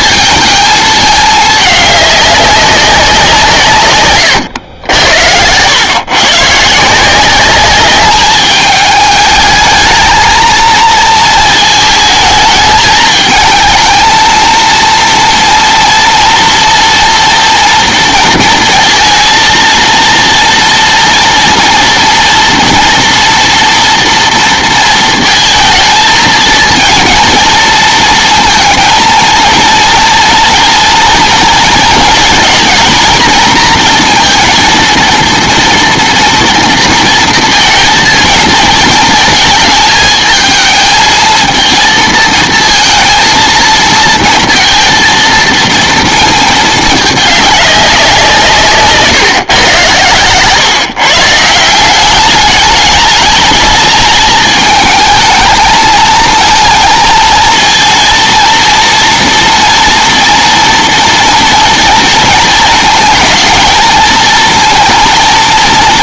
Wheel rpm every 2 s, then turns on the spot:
220, 190, 90, 150, 210, 230, 220, 230, 230, 230, 240, 230, 230, 230, 230, 230, 230, 230, 230, 220, 220, 230, 230, 210, 150, 140, 210, 220, 220, 230, 230, 220, 220.
none